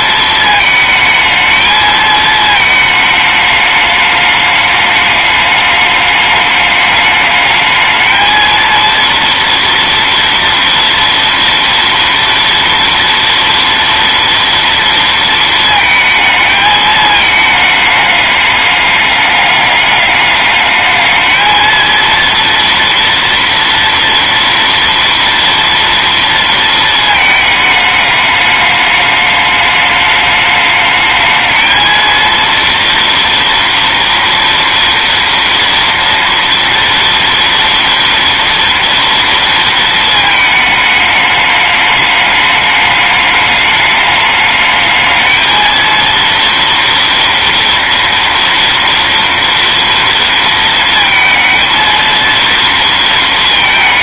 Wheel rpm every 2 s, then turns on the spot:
220, 220, 210, 210, 230, 230, 230, 230, 220, 210, 210, 230, 230, 230, 210, 210, 230, 230, 230, 230, 210, 210, 210, 230, 240, 230, 230.
none